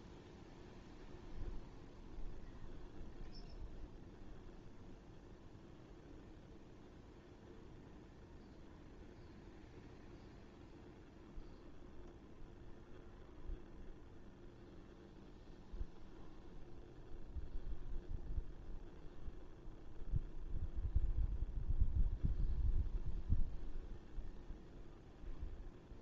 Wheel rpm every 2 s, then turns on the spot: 0, 0, 0, 0, 0, 0, 0, 0, 0, 0, 0, 0, 0.
none